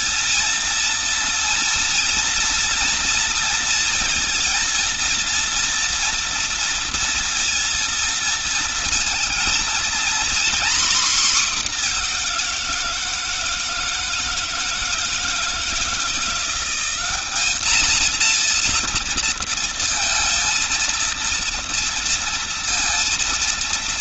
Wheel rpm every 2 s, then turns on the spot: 230, 230, 230, 230, 220, 240, 170, 160, 190, 230, 230, 230.
none